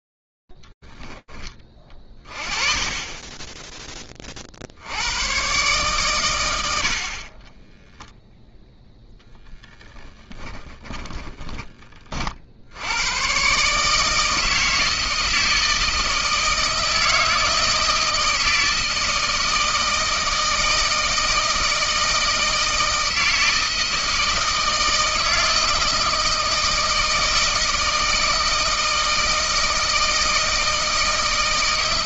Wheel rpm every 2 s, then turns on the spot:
20, 20, 110, 30, 10, 30, 140, 160, 160, 160, 160, 160, 160, 160, 160, 160.
2-4 8-12